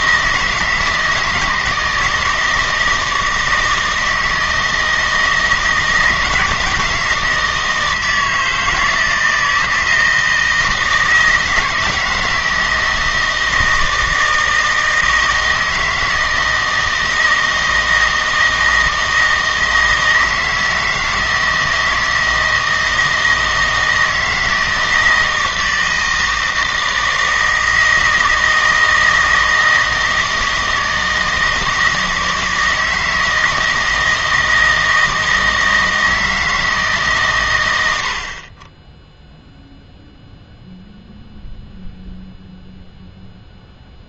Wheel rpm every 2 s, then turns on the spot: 160, 160, 160, 160, 160, 160, 160, 160, 160, 160, 160, 160, 160, 160, 160, 160, 160, 160, 160, 20, 0, 0.
none